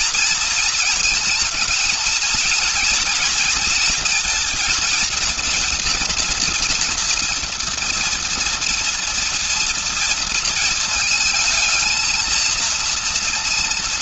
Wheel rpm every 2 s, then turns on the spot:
220, 230, 230, 230, 230, 220, 230.
none